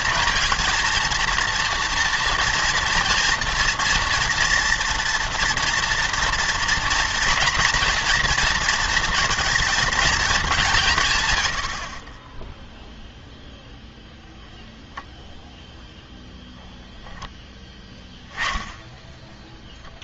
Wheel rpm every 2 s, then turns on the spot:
230, 230, 230, 230, 220, 180, 0, 10, 10, 10.
16-18